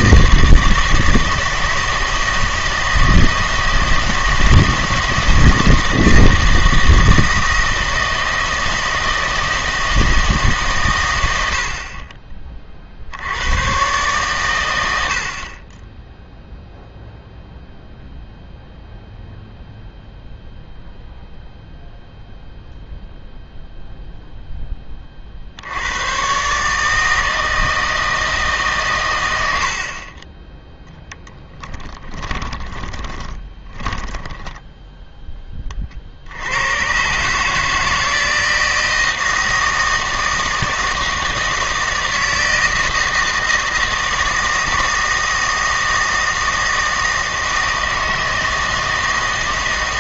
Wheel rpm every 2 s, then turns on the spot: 160, 160, 160, 160, 160, 140, 30, 120, 0, 0, 0, 0, 10, 140, 140, 10, 20, 10, 90, 160, 160, 160, 160, 160, 160.
32-36